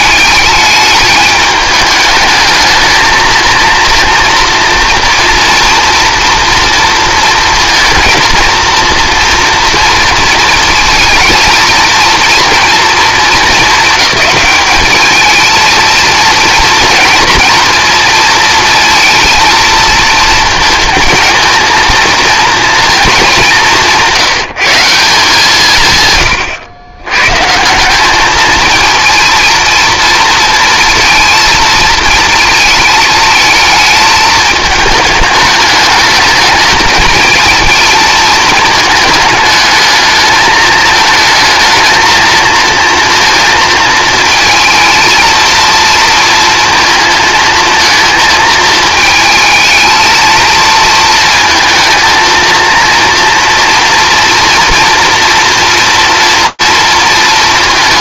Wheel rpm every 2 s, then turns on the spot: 210, 220, 230, 230, 230, 230, 230, 210, 240, 230, 230, 230, 180, 100, 220, 230, 220, 220, 220, 220, 220, 230, 230, 230, 220, 230, 230, 230, 230.
none